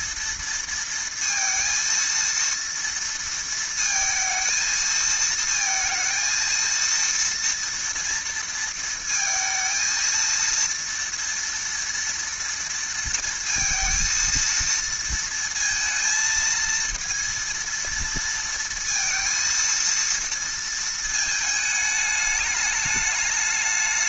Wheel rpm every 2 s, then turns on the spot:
230, 230, 220, 230, 230, 230, 230, 230, 230, 230, 220, 210.
none